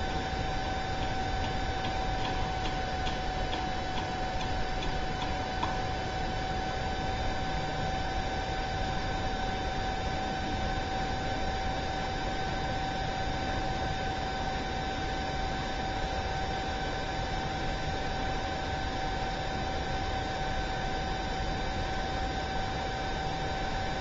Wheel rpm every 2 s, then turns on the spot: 0, 0, 0, 0, 0, 0, 0, 0, 0, 0, 0, 0.
none